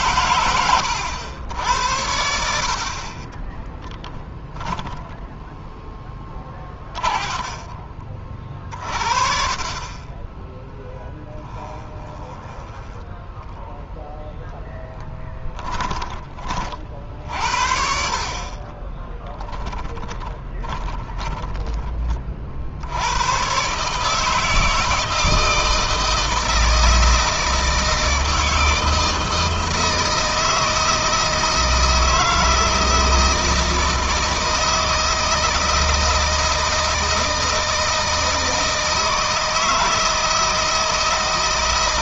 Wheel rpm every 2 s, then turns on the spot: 110, 50, 10, 30, 40, 10, 10, 10, 40, 10, 20, 70, 160, 160, 160, 160, 160, 160, 160, 160, 160.
4-8 10-14 18-22